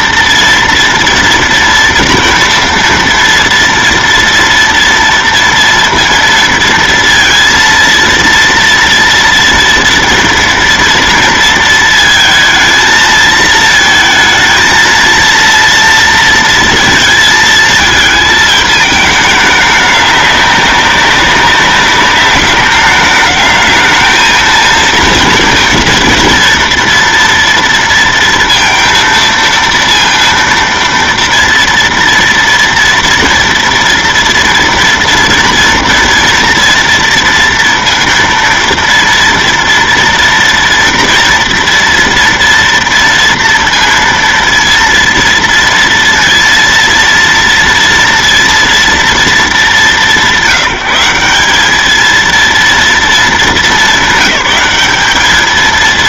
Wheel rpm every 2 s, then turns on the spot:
230, 230, 230, 230, 230, 230, 220, 220, 230, 220, 200, 200, 230, 230, 230, 230, 230, 230, 230, 230, 230, 230, 230, 230, 230, 190, 230, 200.
none